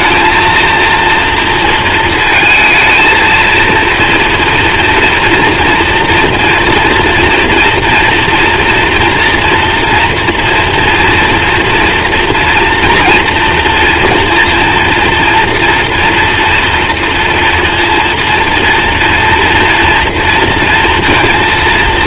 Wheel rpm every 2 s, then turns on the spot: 230, 220, 230, 230, 230, 230, 230, 230, 230, 230, 230.
none